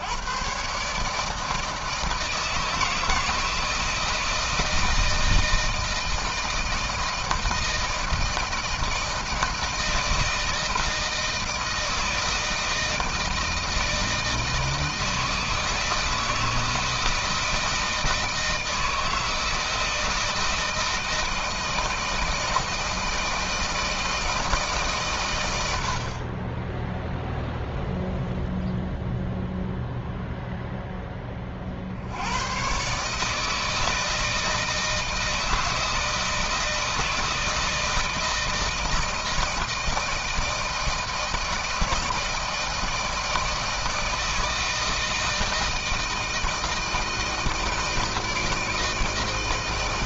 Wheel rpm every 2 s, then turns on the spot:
150, 160, 160, 160, 160, 160, 160, 160, 160, 160, 160, 160, 140, 10, 0, 0, 130, 160, 160, 160, 160, 160, 160, 160, 160.
none